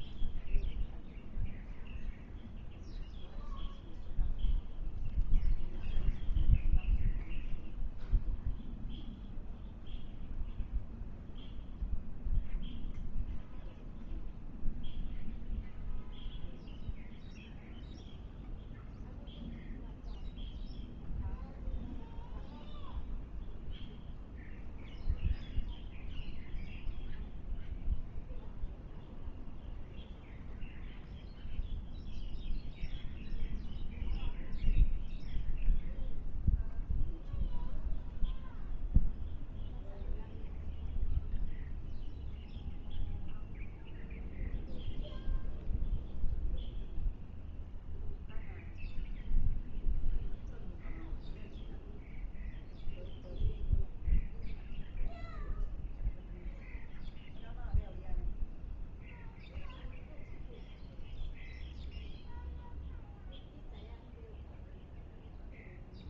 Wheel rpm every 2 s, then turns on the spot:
0, 0, 0, 0, 0, 0, 0, 0, 0, 0, 0, 0, 0, 0, 0, 0, 0, 0, 0, 0, 0, 0, 0, 0, 0, 0, 0, 0, 0, 0, 0, 0, 0.
none